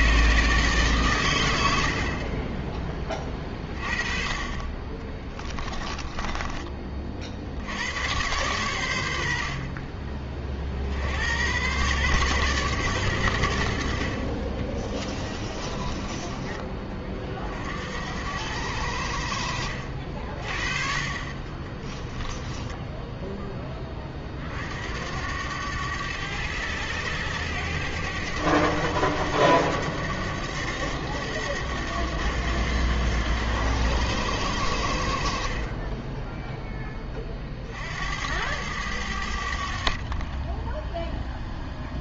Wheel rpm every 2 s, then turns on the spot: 140, 20, 30, 30, 100, 60, 120, 20, 30, 70, 40, 10, 60, 100, 100, 100, 90, 70, 10, 90, 10.
14-16 22-24